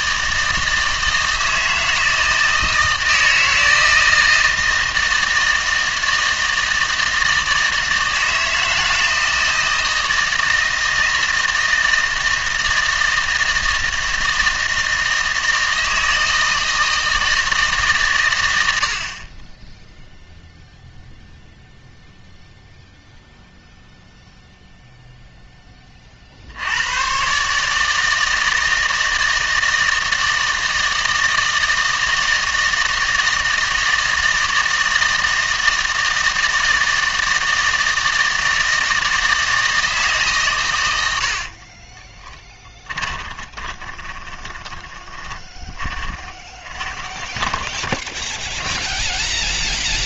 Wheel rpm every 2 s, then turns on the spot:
160, 160, 160, 160, 160, 160, 160, 160, 160, 80, 0, 0, 0, 80, 160, 160, 160, 160, 160, 160, 110, 10, 20, 20, 10.
42-50